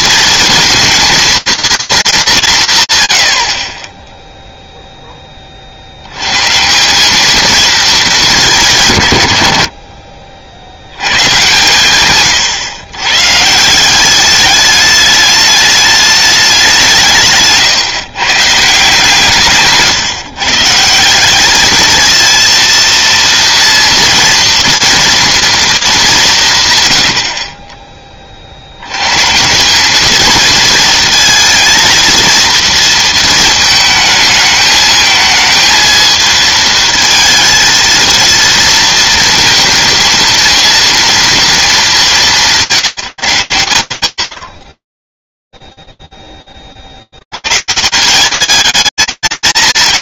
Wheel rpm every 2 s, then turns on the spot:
230, 130, 0, 170, 160, 90, 120, 200, 190, 150, 160, 230, 230, 120, 90, 230, 230, 220, 220, 230, 230, 180, 50, 10, 200.
none